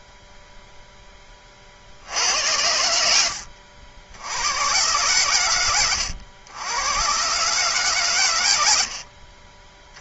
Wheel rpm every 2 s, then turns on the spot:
0, 80, 90, 100, 110.
8-10